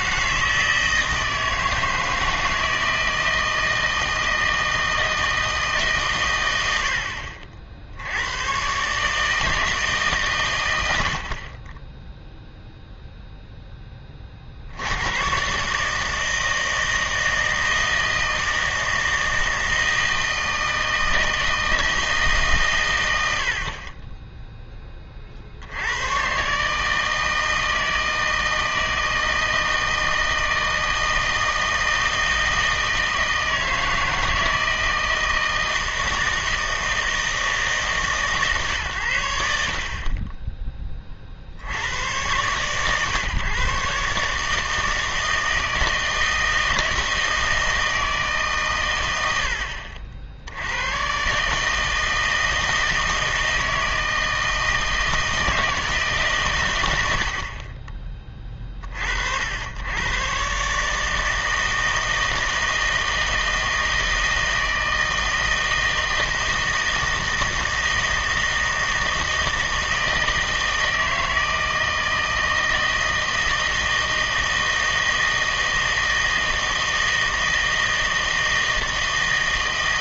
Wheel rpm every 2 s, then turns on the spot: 160, 160, 160, 90, 140, 90, 0, 80, 160, 160, 160, 110, 20, 150, 160, 160, 160, 160, 160, 120, 20, 130, 160, 160, 120, 100, 160, 160, 100, 40, 140, 160, 160, 160, 160, 160, 160, 160, 160, 160.
none